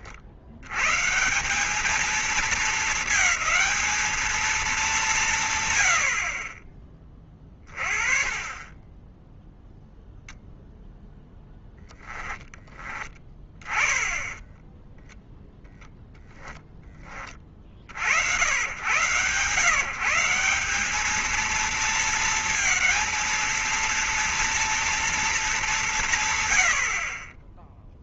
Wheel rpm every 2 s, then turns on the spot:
120, 220, 190, 30, 10, 0, 10, 10, 20, 130, 210, 230, 230, 60.
none